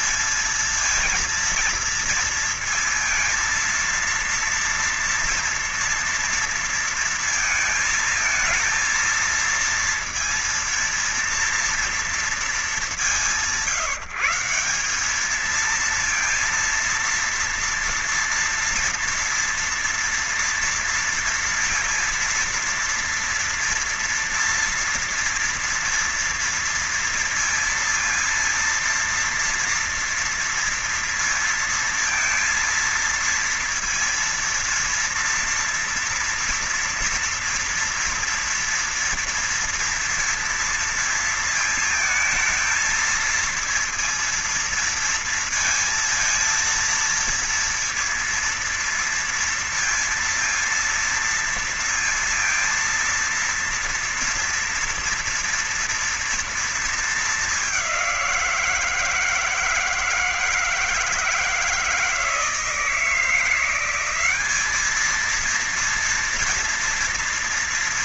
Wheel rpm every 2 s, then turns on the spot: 210, 230, 230, 230, 230, 230, 220, 180, 230, 230, 230, 230, 230, 230, 230, 230, 230, 230, 230, 230, 230, 220, 230, 230, 230, 230, 230, 230, 230, 180, 160, 160, 190, 230.
none